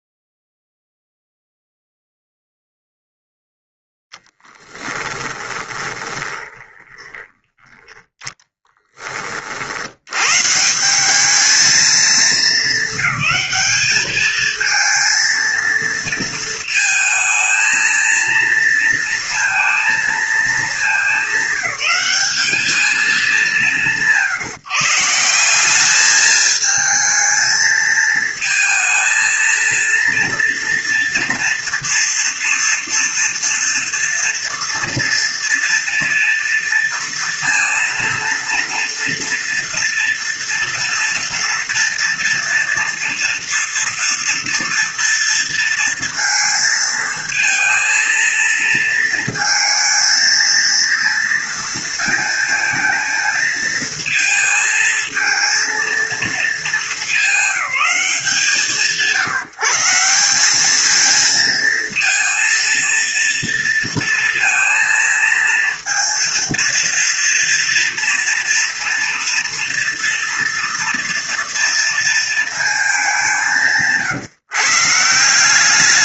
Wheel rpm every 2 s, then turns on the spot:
0, 0, 10, 20, 20, 180, 200, 230, 220, 230, 220, 210, 160, 220, 230, 230, 230, 230, 230, 230, 230, 230, 230, 230, 230, 230, 220, 220, 200, 160, 220, 230, 230, 230, 230, 230, 210, 150.
4-8